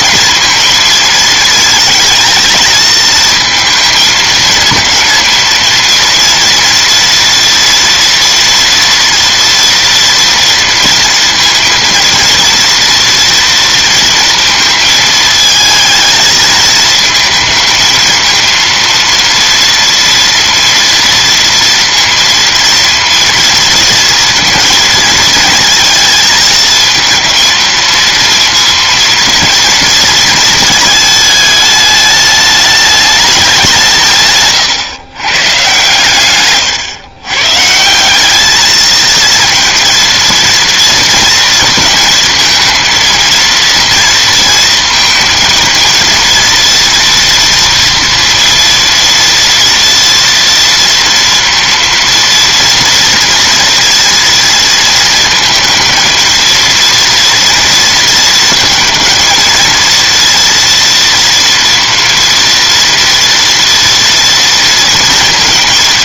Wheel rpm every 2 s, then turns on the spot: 230, 230, 220, 230, 240, 240, 230, 230, 220, 230, 230, 230, 230, 220, 230, 220, 210, 130, 120, 210, 230, 230, 230, 230, 230, 230, 230, 230, 230, 230, 230, 230, 230.
34-36